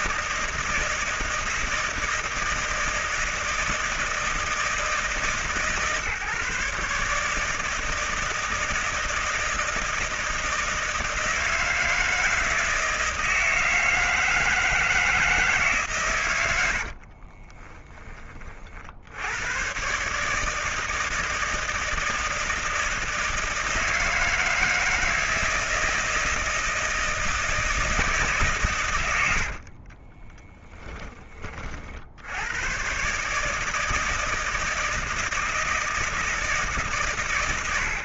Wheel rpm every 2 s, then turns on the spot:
160, 160, 160, 150, 170, 160, 160, 160, 60, 80, 160, 160, 160, 160, 100, 20, 130, 160, 130.
16-18